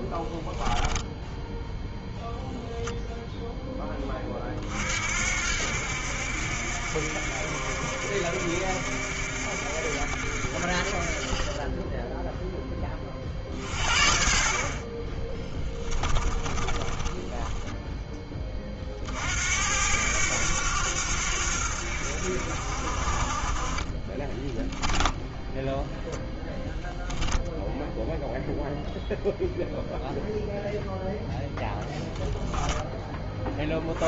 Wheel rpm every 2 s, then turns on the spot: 10, 0, 60, 60, 60, 40, 20, 30, 20, 40, 90, 50, 10, 0, 0, 0, 10.
0-2 16-18 24-26